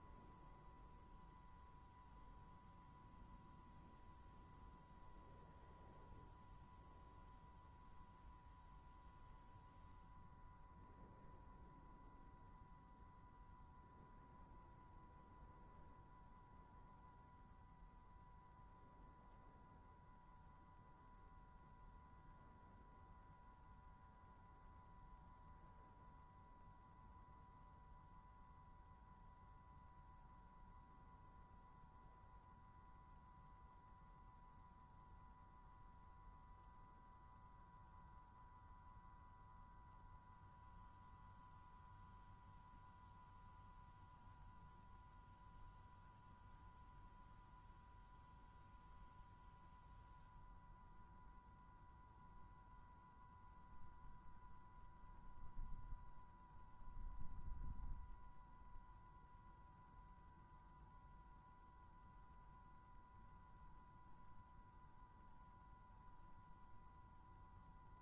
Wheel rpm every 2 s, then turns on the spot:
120, 120, 120, 120, 120, 120, 120, 120, 120, 110, 120, 120, 120, 120, 120, 120, 120, 120, 120, 120, 120, 120, 120, 120, 120, 120, 120, 120, 120, 120, 120, 120, 120, 120.
none